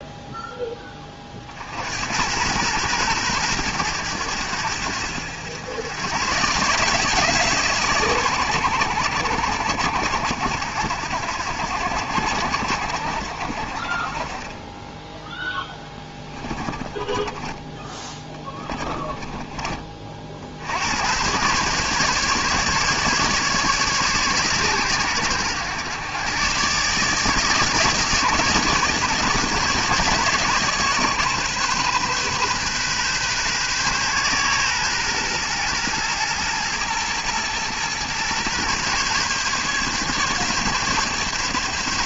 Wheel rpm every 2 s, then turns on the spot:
20, 120, 90, 140, 100, 80, 60, 10, 20, 20, 80, 150, 110, 140, 150, 140, 130, 120, 110, 130, 140.
16-20